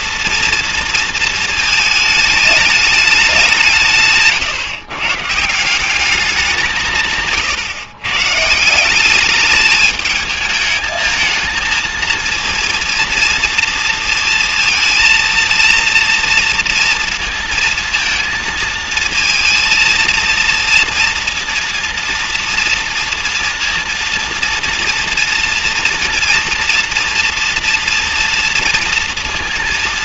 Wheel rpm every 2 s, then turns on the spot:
230, 210, 150, 190, 150, 220, 230, 230, 230, 230, 230, 230, 230, 230, 230.
none